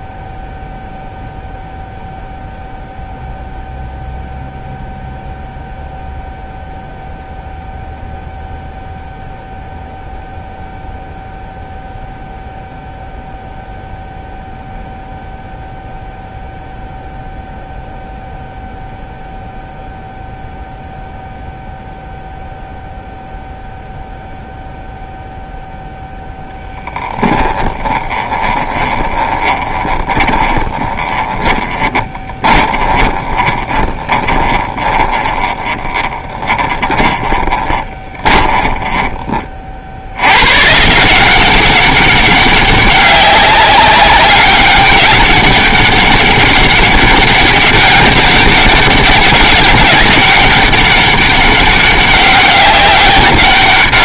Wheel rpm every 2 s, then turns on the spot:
0, 0, 0, 0, 0, 0, 0, 0, 0, 0, 0, 0, 0, 10, 20, 20, 20, 10, 10, 20, 150, 200, 200, 200, 200, 200, 200.
28-38